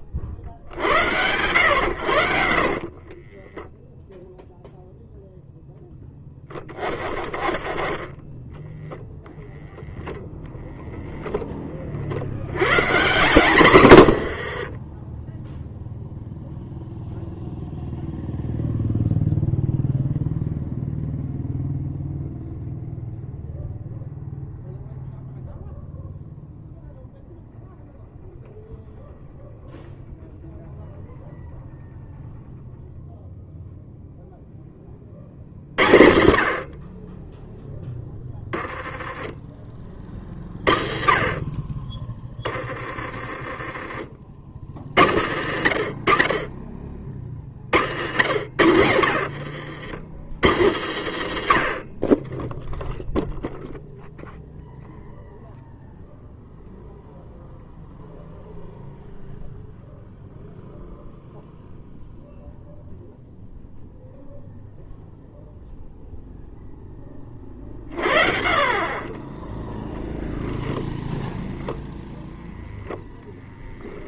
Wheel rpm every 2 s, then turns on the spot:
40, 50, 0, 10, 10, 10, 90, 50, 0, 0, 0, 0, 0, 0, 0, 0, 0, 10, 40, 10, 30, 20, 60, 30, 70, 90, 10, 0, 0, 0, 0, 0, 0, 0, 30, 0, 0.
2-4 14-16 48-50